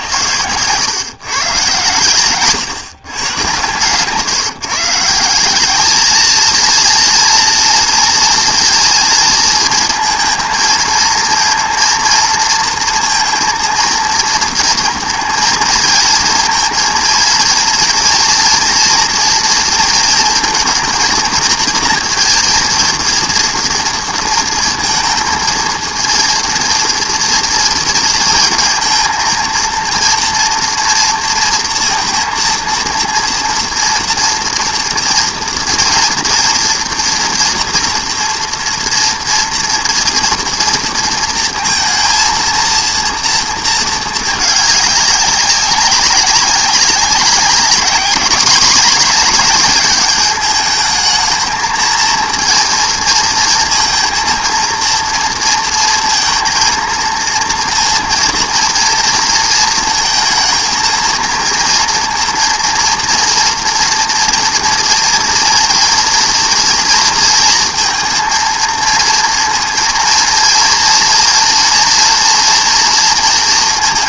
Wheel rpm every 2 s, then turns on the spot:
130, 120, 150, 220, 230, 230, 230, 230, 230, 230, 230, 230, 230, 230, 230, 240, 230, 230, 230, 230, 230, 230, 220, 200, 210, 210, 230, 230, 230, 230, 230, 230, 230, 230, 230, 230, 230.
none